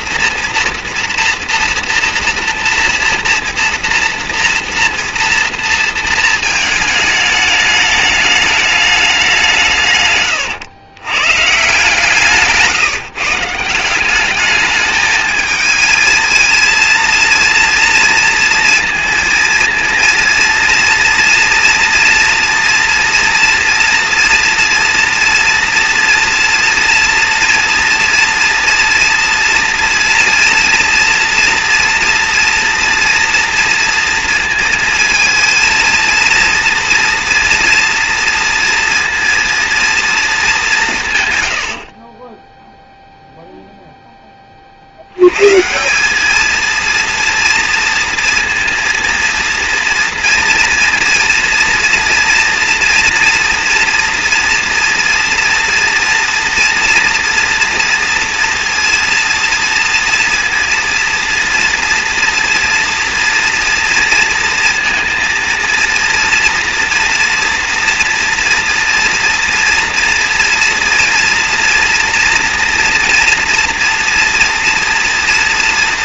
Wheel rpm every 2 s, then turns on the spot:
230, 230, 240, 220, 210, 120, 150, 210, 230, 230, 230, 230, 230, 230, 230, 230, 230, 220, 230, 230, 210, 10, 30, 220, 230, 230, 240, 230, 230, 230, 230, 230, 230, 230, 230, 230, 230, 230.
12-14